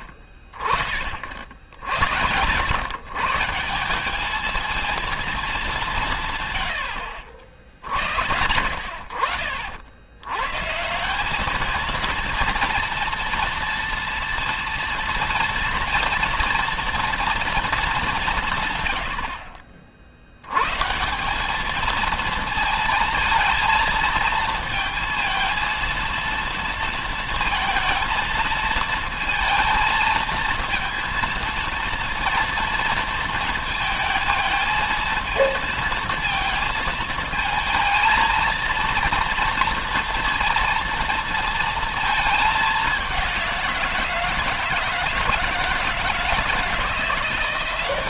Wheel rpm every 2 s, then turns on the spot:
30, 100, 220, 100, 70, 140, 230, 230, 230, 140, 120, 230, 230, 230, 220, 230, 230, 220, 230, 230, 230, 210, 160, 160.
none